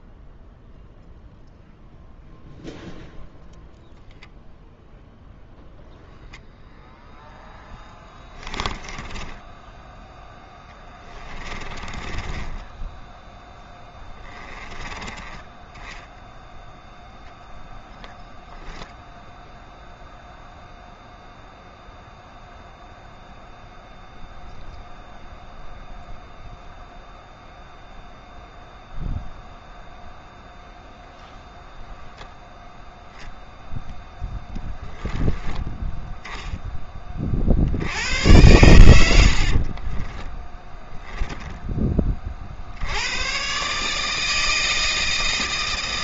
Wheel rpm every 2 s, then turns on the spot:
0, 0, 0, 0, 10, 20, 10, 20, 0, 0, 0, 0, 0, 0, 0, 0, 0, 10, 30, 90, 0, 80, 160.
8-12 14-16